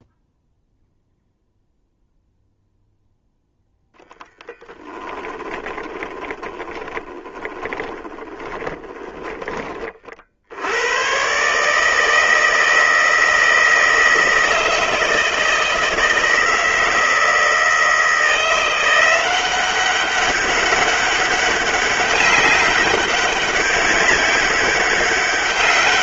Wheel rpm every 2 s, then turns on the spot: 0, 0, 10, 10, 20, 80, 160, 160, 160, 170, 200, 200, 200.
6-10